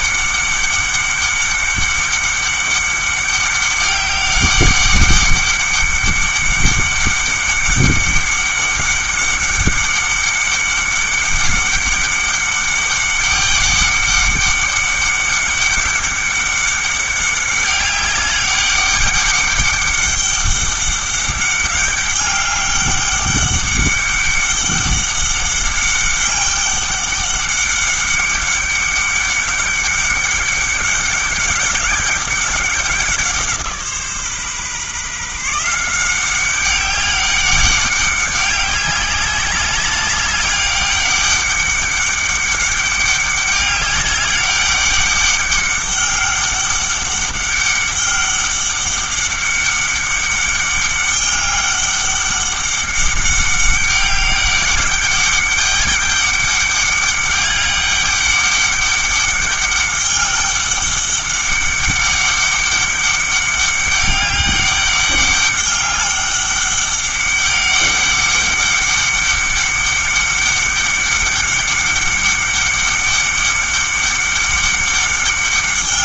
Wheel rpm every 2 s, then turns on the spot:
200, 200, 200, 200, 200, 200, 200, 200, 200, 200, 200, 200, 200, 200, 200, 190, 190, 140, 200, 200, 200, 200, 200, 200, 200, 200, 200, 200, 200, 200, 200, 200, 200, 200, 200, 200, 200, 200.
none